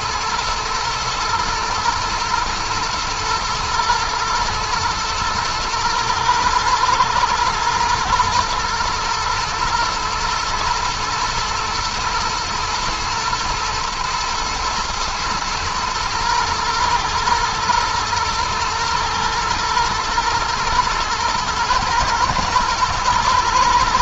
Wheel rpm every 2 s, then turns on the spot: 120, 120, 110, 110, 120, 120, 110, 120, 110, 120, 110, 110.
none